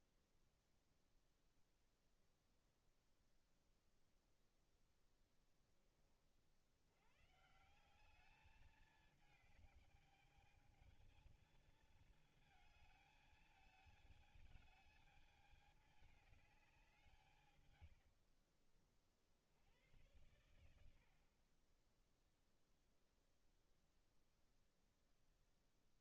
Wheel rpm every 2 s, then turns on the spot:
0, 0, 30, 180, 210, 220, 220, 210, 110, 90, 30, 0, 0.
20-22